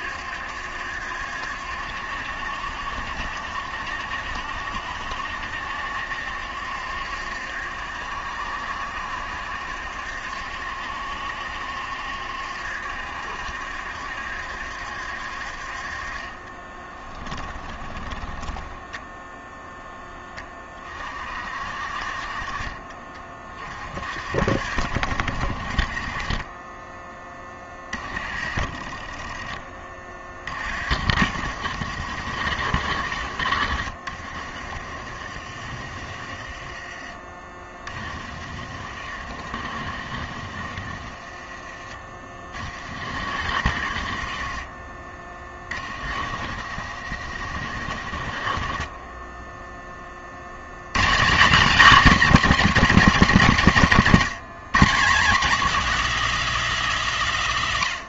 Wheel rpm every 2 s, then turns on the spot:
70, 70, 70, 70, 70, 70, 70, 70, 20, 10, 20, 30, 50, 10, 30, 50, 70, 40, 30, 40, 40, 40, 40, 70, 40, 100, 240, 190, 240.
16-20 34-42